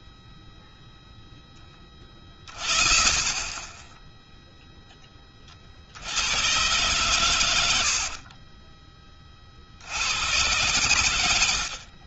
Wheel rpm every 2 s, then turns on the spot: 0, 40, 10, 100, 50, 70.
6-8